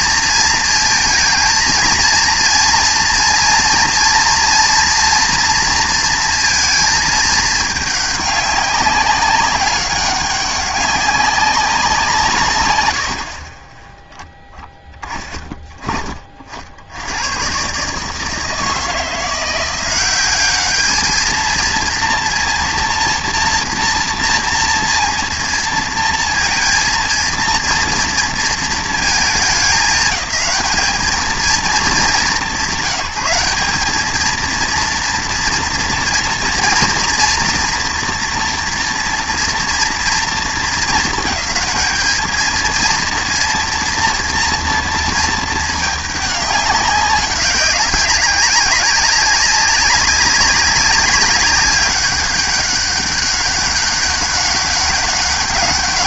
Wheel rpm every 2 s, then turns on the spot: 230, 230, 230, 220, 200, 200, 110, 20, 70, 160, 210, 230, 230, 230, 220, 210, 170, 230, 230, 230, 210, 230, 230, 200, 200, 200, 200, 200.
none